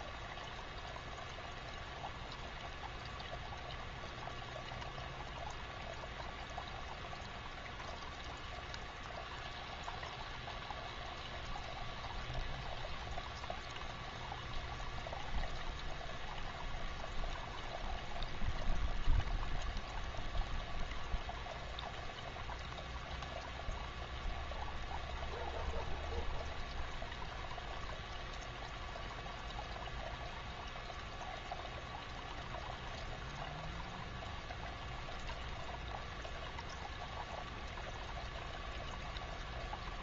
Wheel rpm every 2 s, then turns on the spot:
0, 0, 0, 0, 0, 0, 0, 0, 0, 0, 0, 0, 0, 0, 0, 0, 0, 0, 0, 0.
none